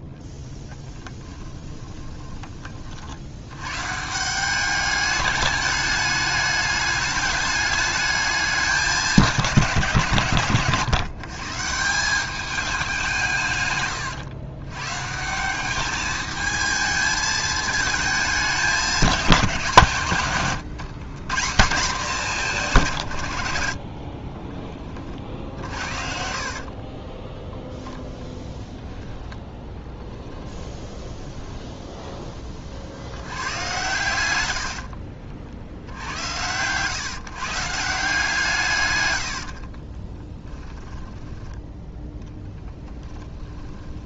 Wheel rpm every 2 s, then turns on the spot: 20, 110, 210, 210, 160, 170, 120, 190, 220, 160, 190, 70, 70, 10, 10, 10, 110, 70, 140, 70, 10, 10.
0-2 12-14 22-26 28-32 38-40 42-44